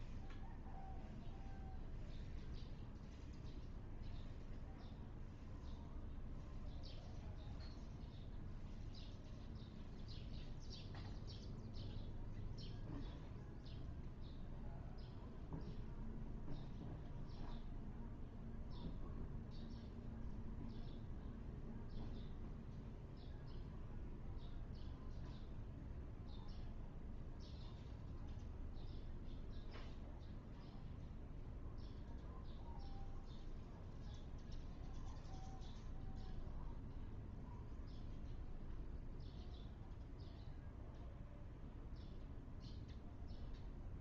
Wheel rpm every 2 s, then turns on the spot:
0, 0, 0, 0, 0, 0, 0, 0, 0, 0, 0, 0, 0, 0, 0, 0, 0, 0, 0, 0, 0, 0.
none